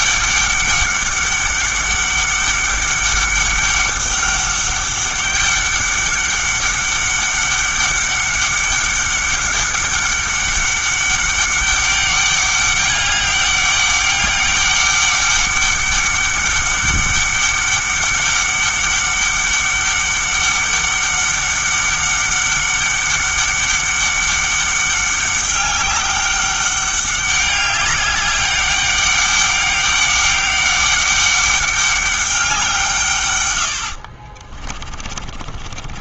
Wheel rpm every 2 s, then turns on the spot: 200, 200, 200, 200, 200, 200, 200, 200, 200, 200, 200, 200, 200, 200, 200, 200, 170, 50.
34-36